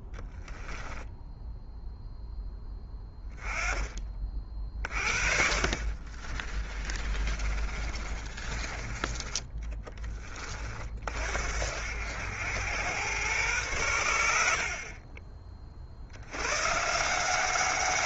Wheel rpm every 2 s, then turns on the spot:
10, 10, 40, 30, 20, 40, 100, 50, 140.
0-2 6-10